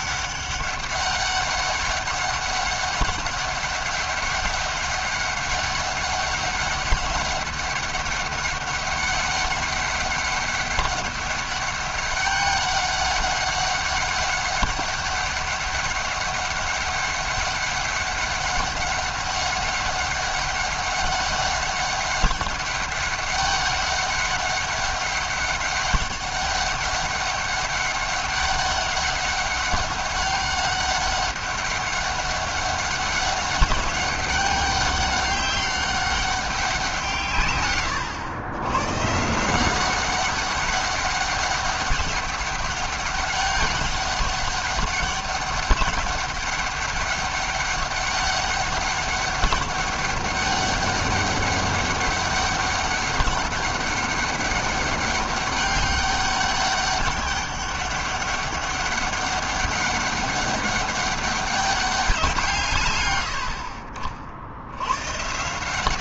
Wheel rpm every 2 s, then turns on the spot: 190, 200, 200, 200, 190, 200, 200, 200, 200, 200, 200, 200, 200, 200, 200, 200, 200, 200, 150, 150, 200, 200, 200, 200, 200, 200, 200, 200, 200, 200, 200, 120, 130.
none